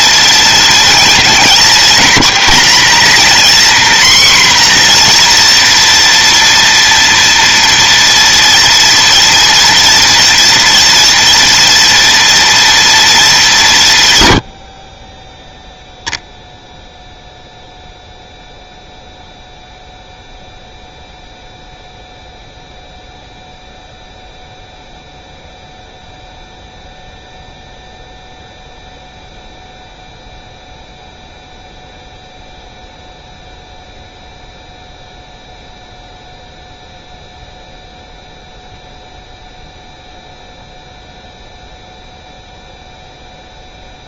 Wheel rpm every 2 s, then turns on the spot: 230, 240, 250, 230, 230, 230, 240, 60, 0, 0, 0, 0, 0, 0, 0, 0, 0, 0, 0, 0, 0, 0.
none